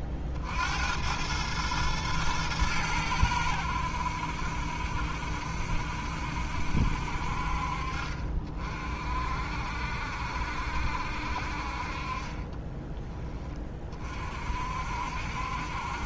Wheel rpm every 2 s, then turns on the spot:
50, 100, 70, 60, 50, 70, 20, 60.
none